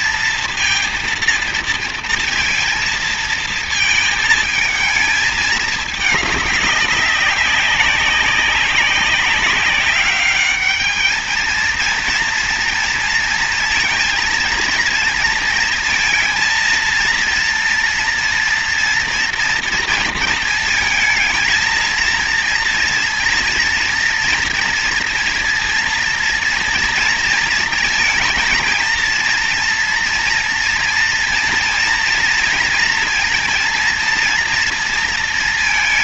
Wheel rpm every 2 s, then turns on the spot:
230, 230, 220, 200, 200, 210, 230, 230, 230, 230, 220, 230, 230, 230, 230, 230, 230, 230.
none